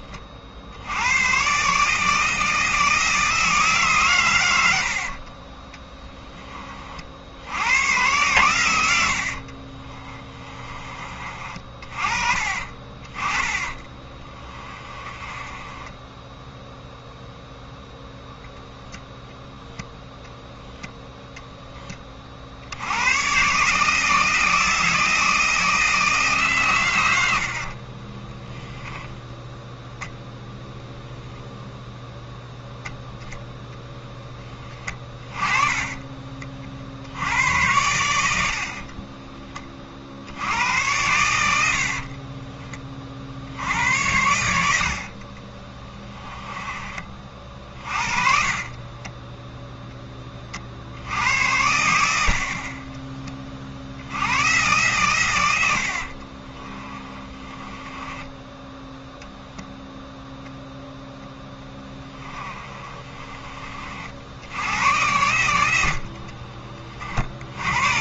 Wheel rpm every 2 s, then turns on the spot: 90, 160, 80, 50, 80, 30, 30, 20, 0, 0, 0, 90, 160, 100, 10, 0, 0, 20, 60, 40, 100, 40, 50, 30, 30, 70, 30, 120, 20, 0, 0, 20, 90, 60.
8-10 12-16 38-40 48-50 56-58 62-64